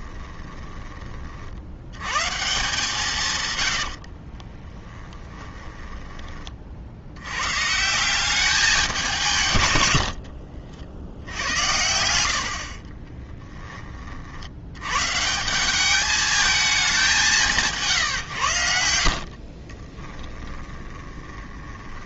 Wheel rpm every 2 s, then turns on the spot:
20, 160, 10, 50, 200, 60, 60, 100, 210, 80, 20.
0-2 4-6 12-14 18-22